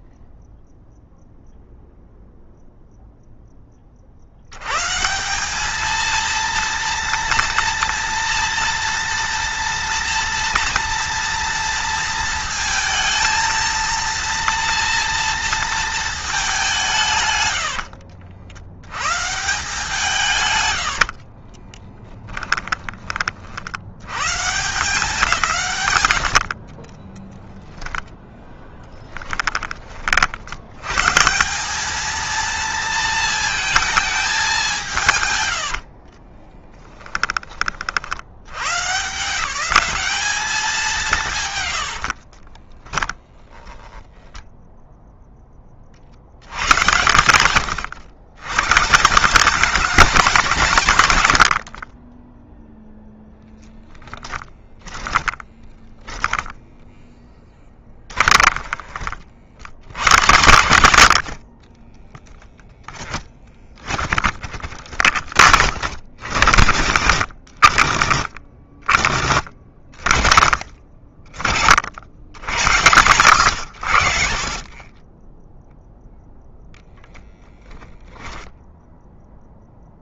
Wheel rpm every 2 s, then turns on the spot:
0, 0, 140, 230, 230, 230, 220, 230, 160, 100, 80, 20, 180, 40, 10, 110, 230, 180, 10, 110, 180, 20, 0, 100, 160, 130, 0, 20, 20, 30, 90, 20, 60, 100, 50, 50, 120, 30, 0, 0.
20-22 26-30 36-38 42-44 54-58 62-64 68-70